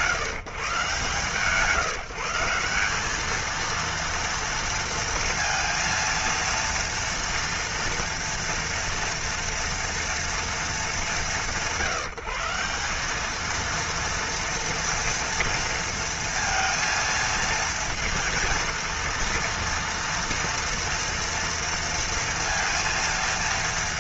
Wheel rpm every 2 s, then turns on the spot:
140, 180, 230, 230, 230, 200, 190, 230, 230, 230, 230, 230.
none